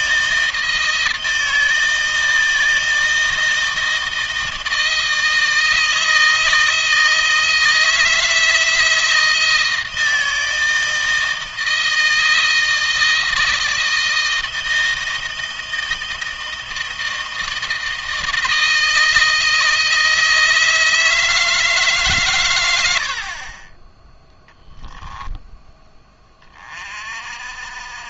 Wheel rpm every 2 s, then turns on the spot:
160, 160, 160, 160, 160, 160, 160, 160, 160, 160, 160, 80, 0, 30.
none